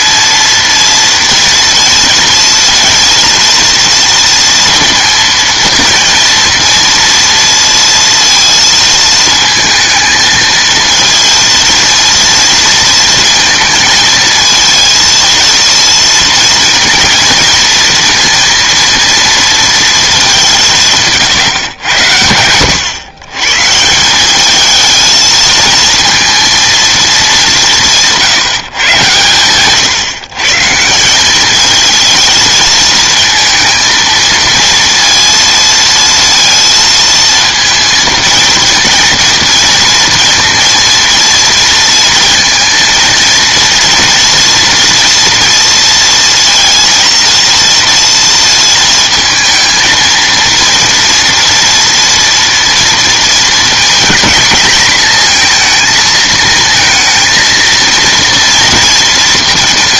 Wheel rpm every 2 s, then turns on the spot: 230, 230, 230, 230, 230, 230, 230, 220, 230, 230, 170, 100, 220, 220, 140, 170, 230, 230, 230, 230, 230, 230, 230, 230, 230, 230, 230, 220, 220, 230.
none